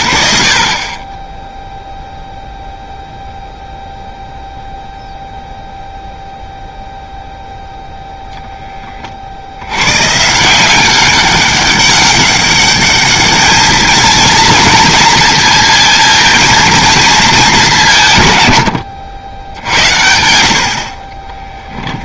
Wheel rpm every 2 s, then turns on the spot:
60, 0, 0, 0, 20, 180, 200, 220, 230, 100, 70.
none